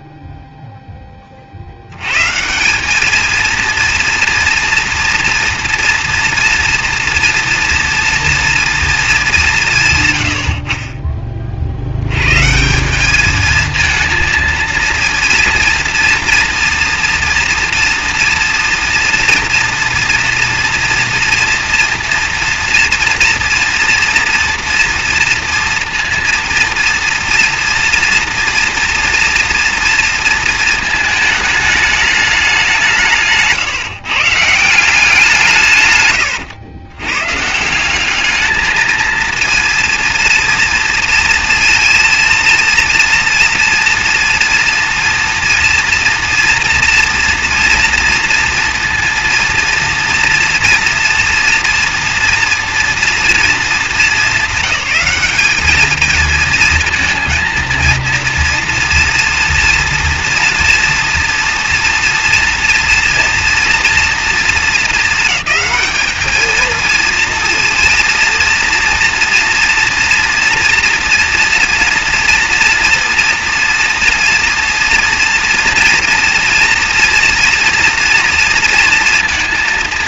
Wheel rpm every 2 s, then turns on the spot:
0, 150, 230, 230, 230, 70, 150, 220, 230, 230, 230, 230, 230, 230, 240, 230, 190, 150, 110, 220, 230, 230, 230, 240, 230, 230, 230, 200, 220, 230, 230, 230, 230, 220, 230, 230, 230, 230, 230, 230.
none